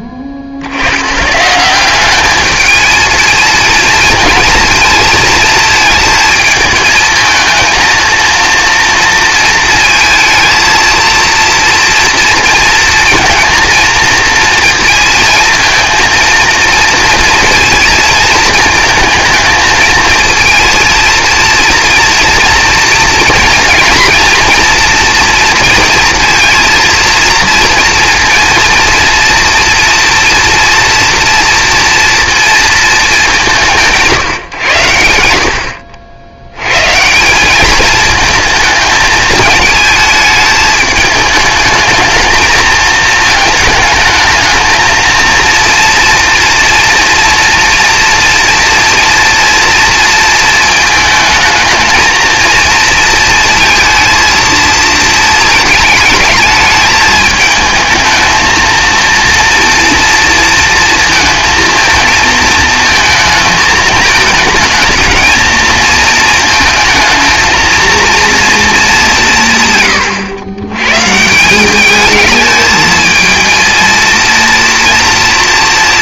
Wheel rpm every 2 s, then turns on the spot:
90, 220, 230, 220, 230, 230, 230, 230, 230, 220, 230, 230, 230, 230, 230, 230, 220, 100, 130, 220, 210, 220, 230, 230, 240, 220, 230, 230, 220, 230, 230, 220, 220, 220, 200, 130, 220, 230.
none